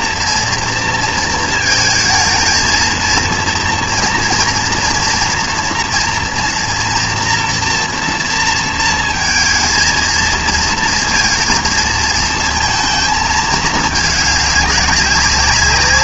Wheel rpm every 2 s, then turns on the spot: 230, 220, 240, 230, 230, 230, 230, 200.
none